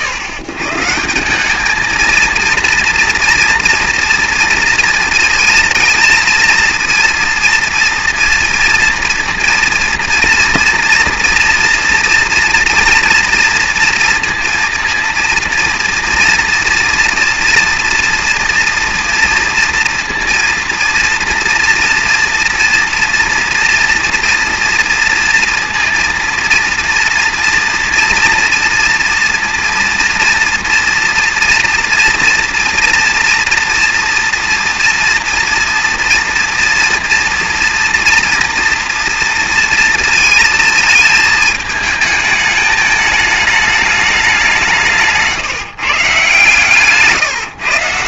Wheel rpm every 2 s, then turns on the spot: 130, 230, 230, 230, 230, 230, 230, 230, 230, 240, 230, 230, 240, 240, 230, 230, 230, 230, 230, 240, 220, 210, 170, 140.
none